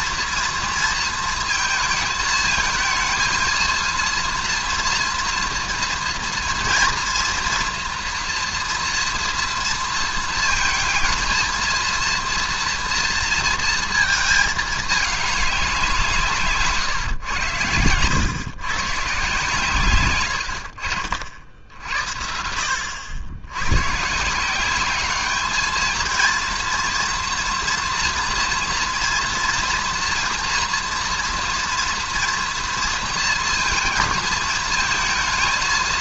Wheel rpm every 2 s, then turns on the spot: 230, 220, 230, 230, 230, 230, 230, 220, 140, 120, 70, 70, 190, 230, 230, 230, 230, 220.
none